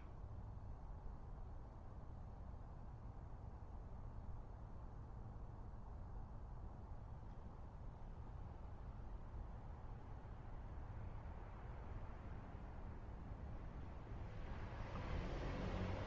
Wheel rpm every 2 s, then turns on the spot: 0, 0, 0, 0, 0, 0, 0, 0.
none